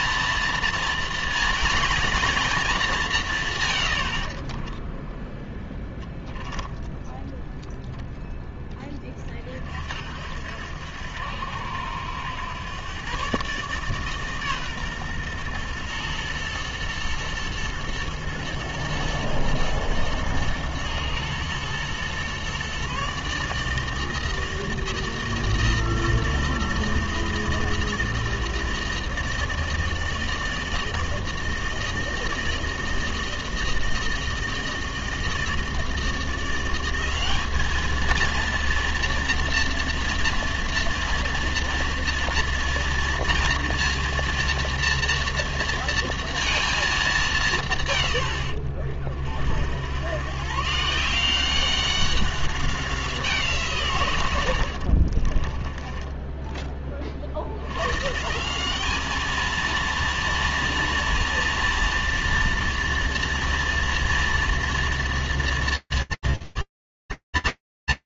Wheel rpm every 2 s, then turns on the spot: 230, 230, 60, 10, 10, 70, 100, 140, 110, 120, 110, 120, 160, 160, 160, 160, 160, 160, 170, 230, 230, 240, 230, 230, 100, 120, 190, 110, 10, 160, 230, 230, 230, 230.
6-8 56-58